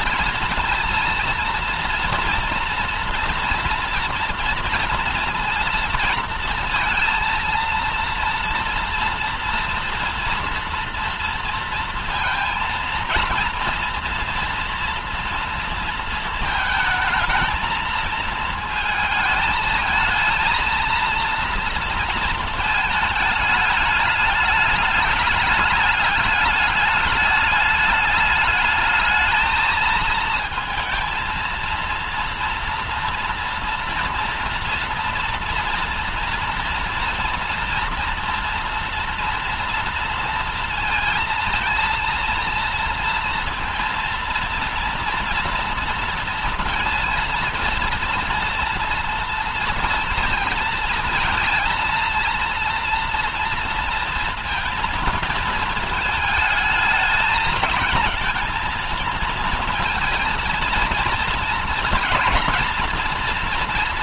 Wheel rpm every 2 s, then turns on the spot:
230, 230, 230, 230, 230, 230, 230, 230, 220, 220, 230, 220, 210, 210, 210, 220, 230, 230, 230, 230, 230, 230, 230, 230, 240, 230, 230, 230, 220, 230, 230, 230.
none